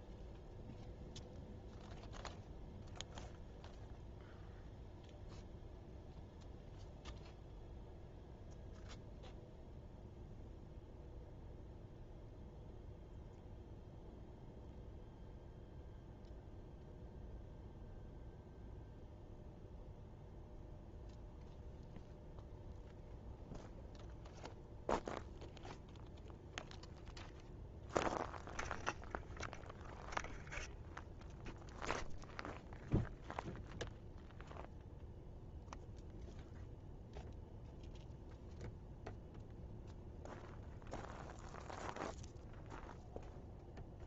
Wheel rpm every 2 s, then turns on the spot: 0, 0, 0, 0, 0, 0, 0, 0, 0, 0, 0, 0, 0, 0, 0, 0, 0, 0, 0, 0, 0, 0.
none